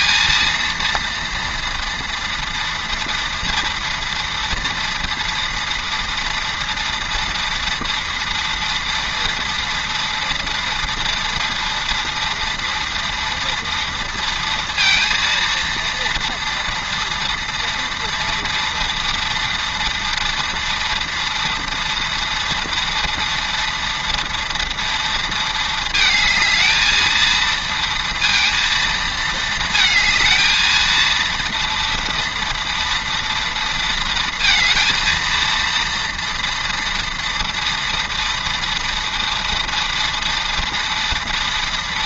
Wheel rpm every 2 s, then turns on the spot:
230, 230, 230, 230, 230, 230, 230, 230, 230, 230, 230, 230, 230, 220, 230, 220, 230, 230, 230, 230, 230.
none